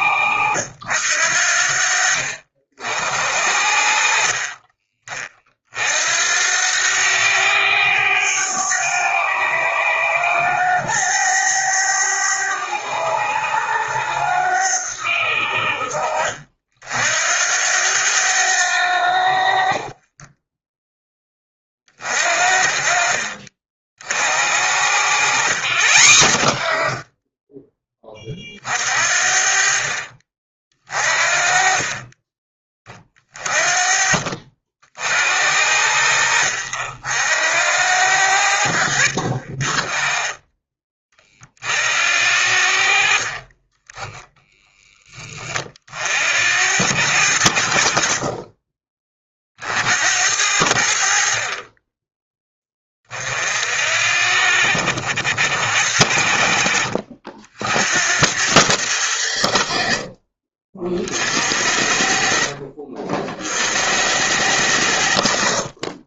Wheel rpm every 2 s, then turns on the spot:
70, 50, 40, 90, 100, 100, 100, 80, 70, 70, 20, 50, 70, 20, 40, 30, 30, 60, 70, 40, 40, 50, 30, 60, 30, 40, 40, 60, 60, 70, 40, 60, 70.
2-4 18-20